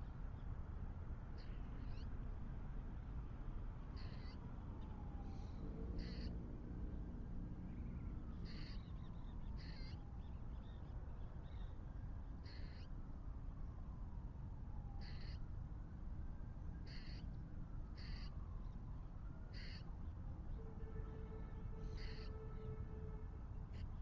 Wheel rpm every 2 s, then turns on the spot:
0, 0, 0, 0, 0, 0, 0, 0, 0, 0, 0, 0.
none